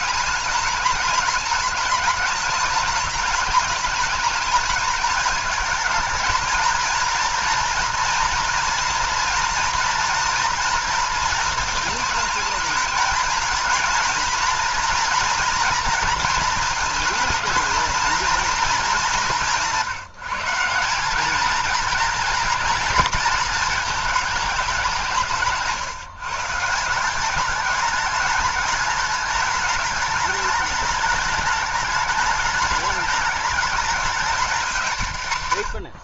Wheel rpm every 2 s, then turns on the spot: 210, 210, 220, 230, 240, 230, 220, 230, 230, 220, 190, 230, 190, 170, 210, 210, 220, 180.
none